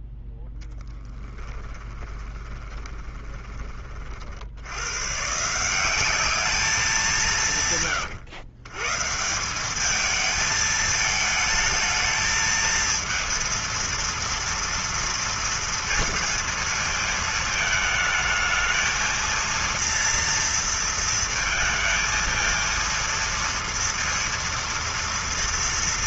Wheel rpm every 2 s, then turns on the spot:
0, 20, 60, 210, 130, 220, 220, 230, 230, 220, 230, 220, 230.
2-4